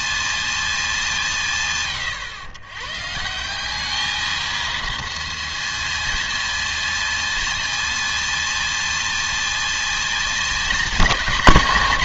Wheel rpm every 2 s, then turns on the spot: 120, 220, 230, 230, 210, 160.
none